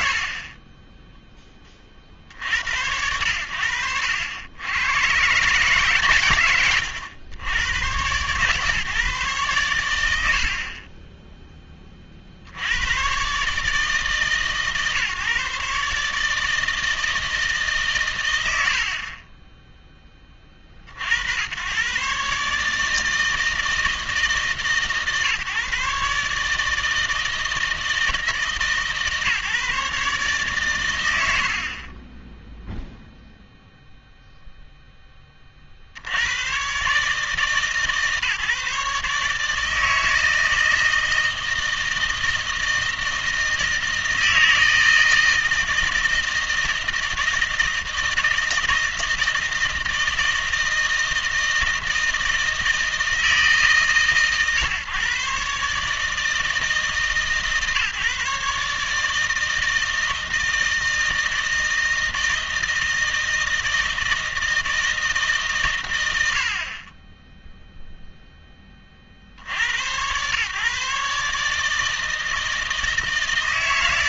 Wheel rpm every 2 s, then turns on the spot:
30, 80, 100, 100, 140, 40, 90, 140, 160, 80, 50, 150, 140, 160, 150, 120, 0, 0, 130, 150, 160, 160, 160, 160, 160, 160, 160, 140, 150, 150, 160, 160, 160, 50, 30, 140, 160.
0-2 6-8